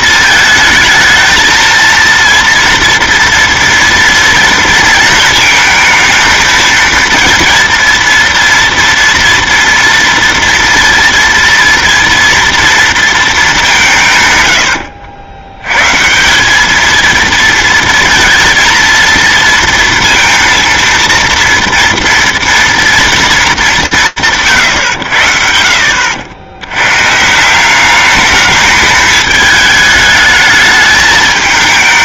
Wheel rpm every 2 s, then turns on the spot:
220, 230, 230, 230, 240, 230, 230, 90, 210, 230, 230, 230, 80, 100, 210, 210.
none